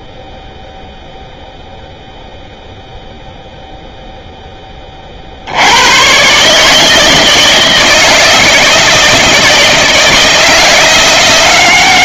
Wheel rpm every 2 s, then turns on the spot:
0, 0, 0, 130, 160, 160.
none